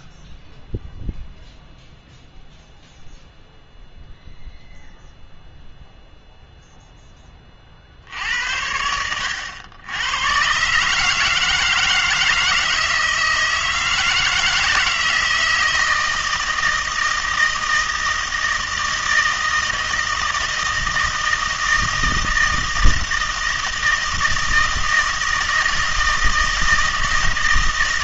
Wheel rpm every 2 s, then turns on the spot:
0, 0, 0, 0, 70, 130, 160, 160, 160, 160, 160, 160, 160, 160.
none